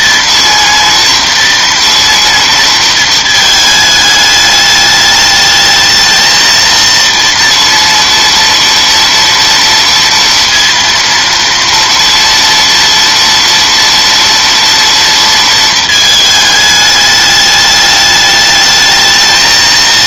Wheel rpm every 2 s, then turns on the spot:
230, 230, 210, 230, 230, 230, 230, 230, 220, 210.
none